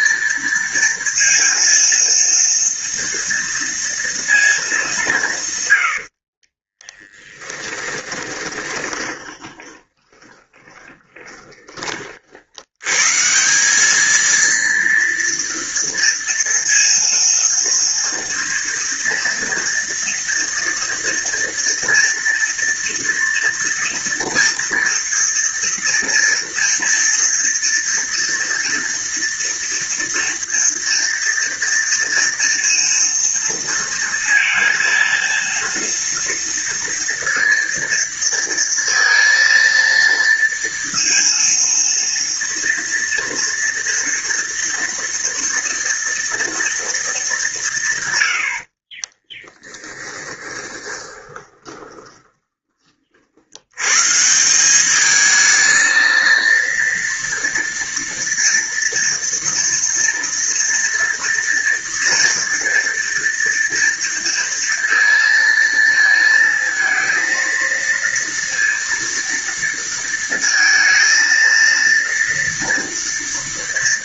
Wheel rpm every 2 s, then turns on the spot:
230, 230, 190, 20, 20, 20, 120, 230, 230, 230, 230, 230, 230, 230, 230, 230, 230, 230, 230, 230, 230, 230, 230, 220, 40, 20, 40, 200, 230, 230, 230, 230, 230, 230, 230, 230, 230.
6-12 48-52